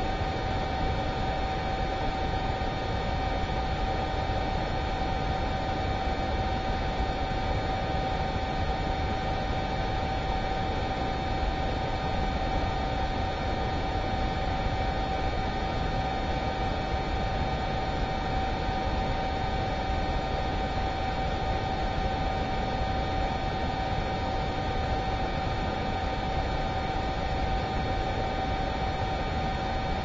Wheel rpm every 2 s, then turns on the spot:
0, 0, 0, 0, 0, 0, 0, 0, 0, 0, 0, 0, 0, 0, 0.
none